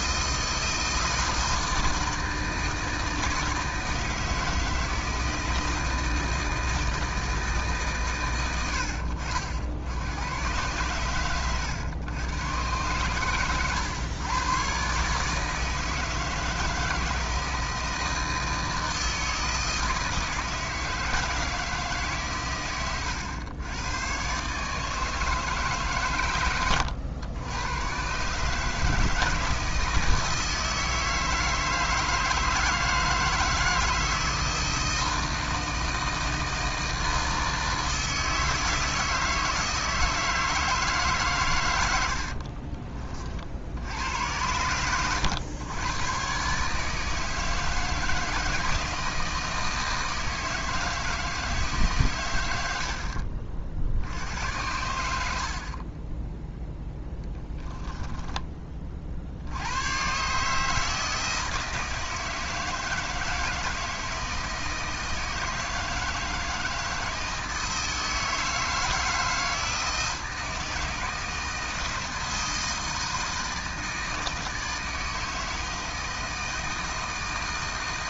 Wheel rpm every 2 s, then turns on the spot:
160, 160, 160, 130, 100, 110, 110, 160, 160, 160, 150, 120, 120, 130, 160, 160, 160, 160, 160, 160, 90, 70, 110, 160, 160, 150, 60, 50, 20, 80, 160, 160, 160, 160, 160, 160, 160, 160, 160.
56-58